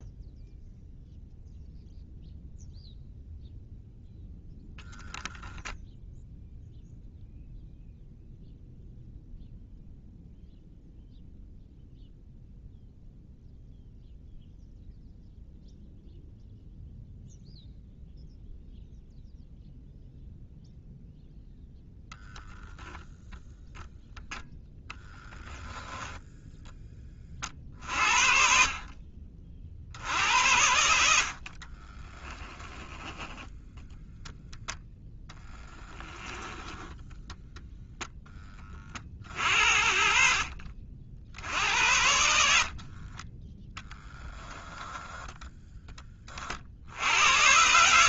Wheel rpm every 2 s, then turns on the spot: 0, 0, 0, 0, 0, 0, 0, 0, 0, 0, 0, 0, 0, 20, 40, 80, 10, 0, 10, 40, 50, 30, 10, 70.
36-38 42-44